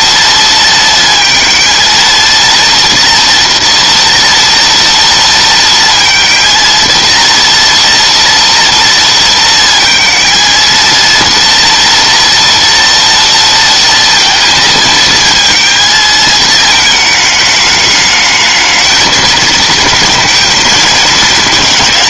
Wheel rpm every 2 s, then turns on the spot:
230, 230, 230, 230, 230, 230, 230, 220, 220, 220, 220.
none